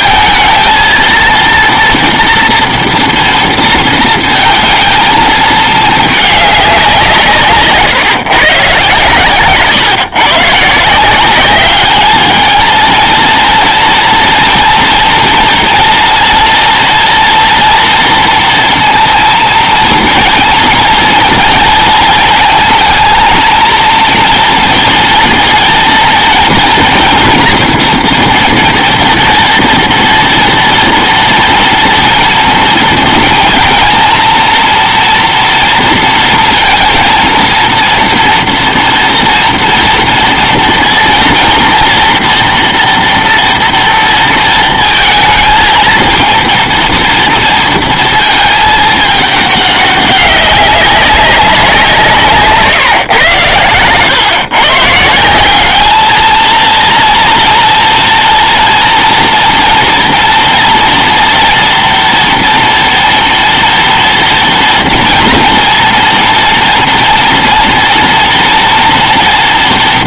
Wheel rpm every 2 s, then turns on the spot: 220, 230, 230, 200, 140, 140, 220, 240, 230, 230, 230, 220, 230, 230, 230, 230, 230, 230, 230, 230, 230, 240, 230, 230, 220, 200, 150, 130, 220, 230, 230, 230, 230, 230, 230.
none